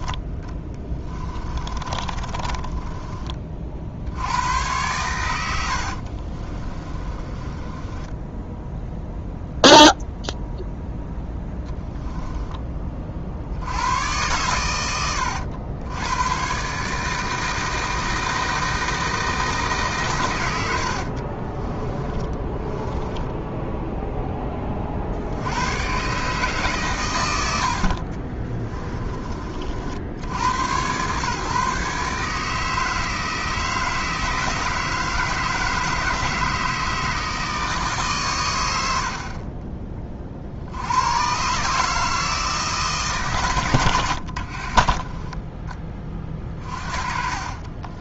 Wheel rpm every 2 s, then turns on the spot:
20, 20, 90, 20, 0, 0, 30, 110, 140, 160, 80, 10, 40, 140, 20, 120, 160, 160, 160, 80, 90, 160, 40, 40.
0-4 6-8 20-22 28-30 44-46